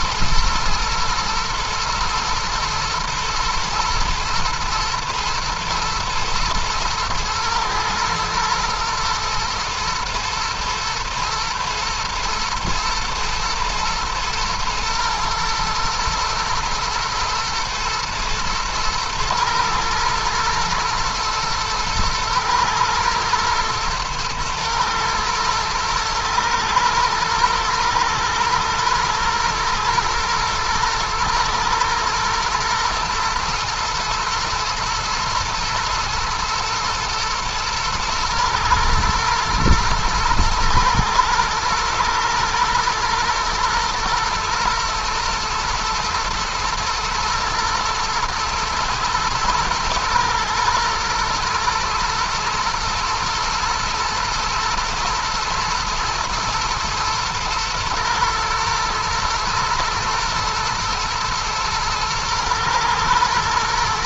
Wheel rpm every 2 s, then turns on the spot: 120, 110, 120, 110, 120, 120, 110, 110, 120, 110, 110, 120, 110, 110, 120, 120, 120, 110, 110, 110, 110, 120, 110, 110, 110, 110, 110, 110, 120, 110, 120, 120.
none